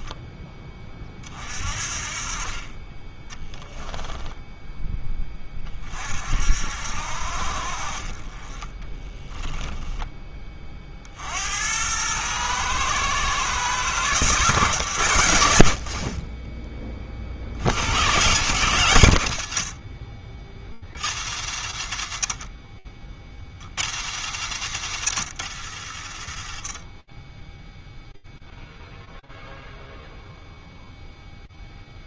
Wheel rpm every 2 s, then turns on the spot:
20, 30, 10, 60, 30, 20, 120, 140, 20, 120, 60, 40, 80, 20, 0, 0.
none